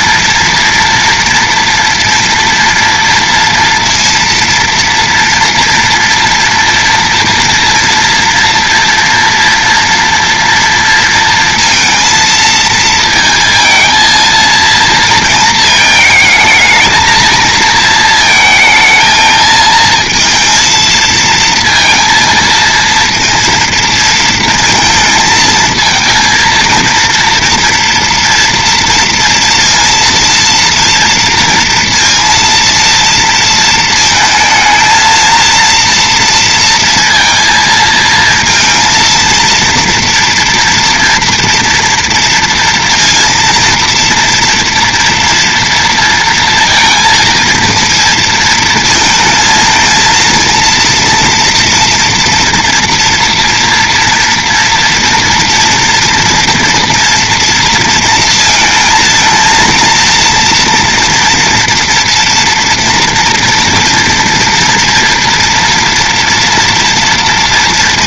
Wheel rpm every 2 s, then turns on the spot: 230, 230, 230, 230, 230, 230, 230, 230, 220, 220, 230, 230, 220, 230, 240, 230, 230, 220, 230, 230, 230, 230, 230, 230, 230, 230, 230, 230, 230, 230, 230, 230, 230, 230.
none